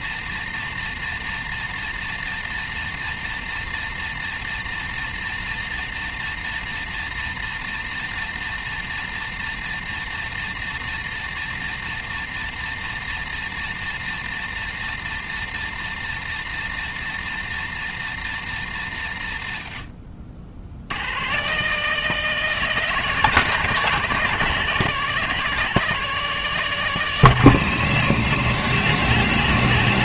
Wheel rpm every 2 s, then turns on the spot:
120, 120, 120, 120, 120, 120, 120, 120, 120, 100, 110, 180, 180, 160, 130.
none